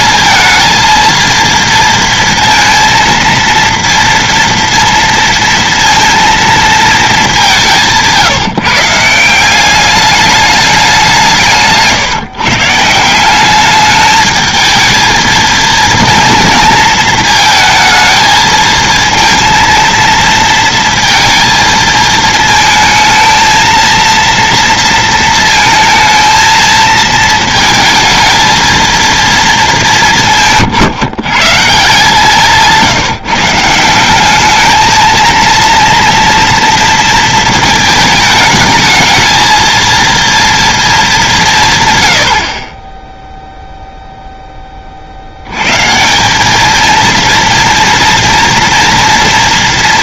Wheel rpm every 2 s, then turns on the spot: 220, 230, 230, 230, 150, 200, 150, 220, 230, 220, 230, 230, 230, 220, 220, 150, 160, 220, 230, 210, 230, 40, 20, 210, 240.
32-34